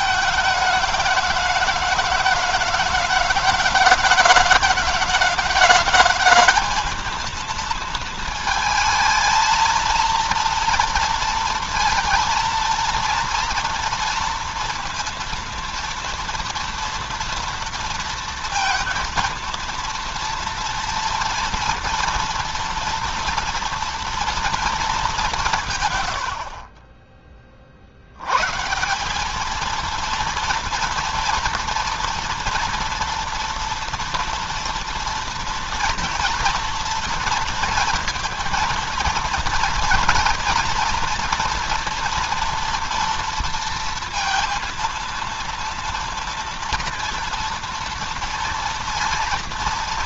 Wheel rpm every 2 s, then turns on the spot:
210, 210, 210, 220, 220, 230, 230, 230, 230, 230, 230, 240, 230, 60, 150, 230, 230, 230, 240, 230, 230, 230, 230, 230, 230.
none